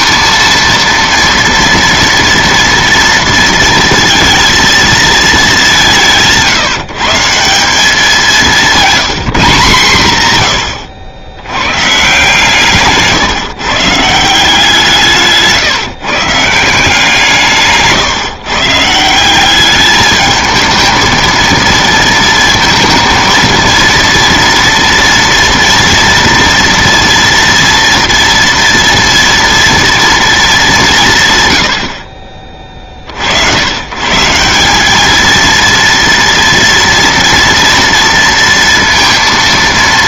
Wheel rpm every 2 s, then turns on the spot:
230, 230, 220, 150, 190, 100, 150, 170, 170, 160, 220, 230, 230, 230, 230, 170, 30, 190, 240, 230.
none